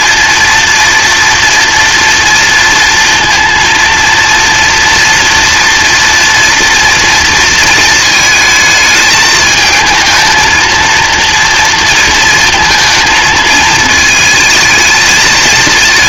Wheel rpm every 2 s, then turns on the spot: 230, 230, 230, 230, 220, 230, 220, 220.
none